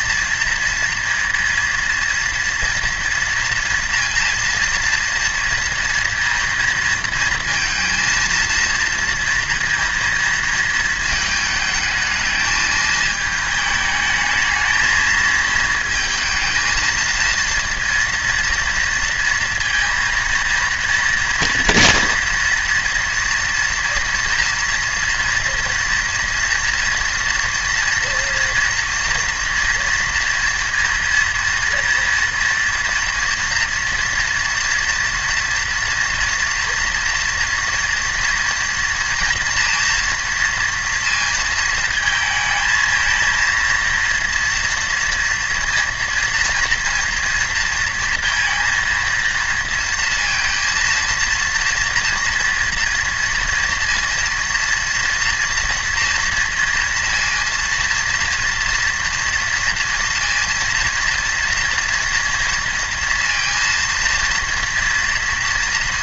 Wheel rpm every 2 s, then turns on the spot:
230, 230, 230, 230, 230, 230, 220, 220, 230, 240, 230, 230, 230, 240, 230, 230, 230, 230, 240, 240, 230, 220, 230, 230, 230, 230, 230, 230, 230, 230, 230, 230, 230.
none